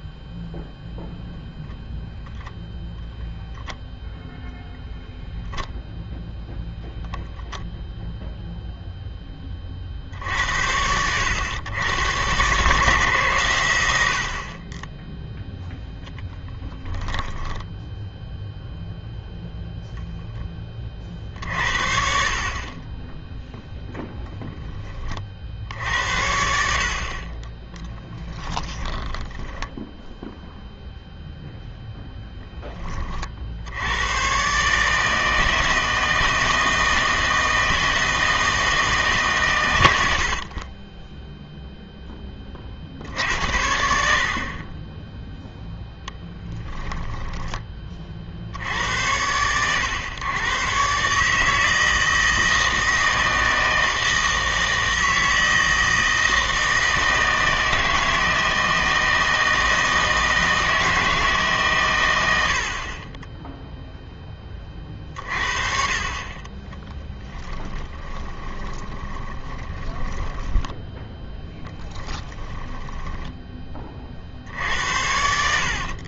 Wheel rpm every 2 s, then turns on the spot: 0, 0, 0, 0, 0, 80, 140, 20, 10, 0, 20, 30, 20, 60, 10, 0, 10, 140, 160, 160, 20, 50, 30, 10, 80, 130, 160, 160, 160, 160, 160, 60, 30, 10, 20, 10, 10, 60.
16-18 28-30 46-48 66-74